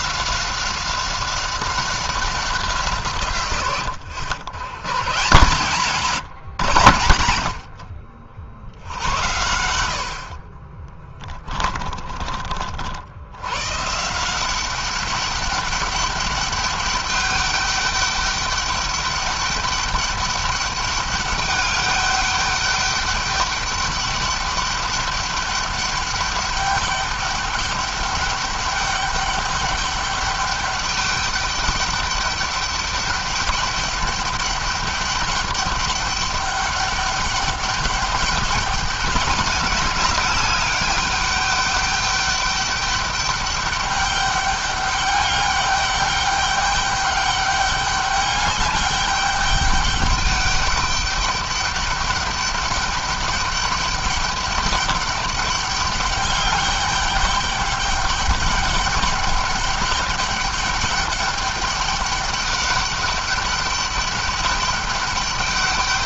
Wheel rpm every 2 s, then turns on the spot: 190, 160, 120, 130, 80, 30, 60, 190, 200, 200, 200, 200, 200, 200, 200, 200, 200, 200, 200, 200, 200, 200, 200, 200, 200, 200, 200, 200, 200, 210, 200, 200, 200.
10-12